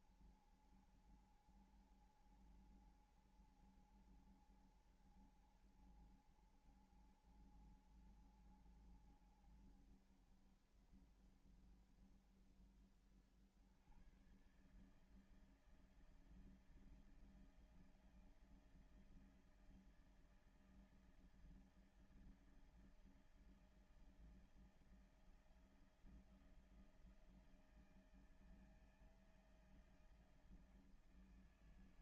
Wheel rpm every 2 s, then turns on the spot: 70, 70, 70, 70, 70, 70, 60, 120, 160, 160, 160, 160, 160, 170, 160, 160.
none